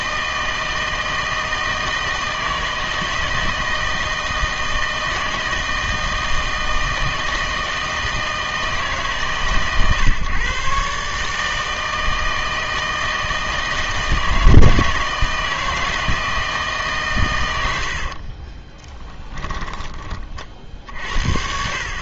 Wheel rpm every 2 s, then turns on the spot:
160, 160, 160, 160, 160, 140, 160, 160, 150, 30, 60.
18-20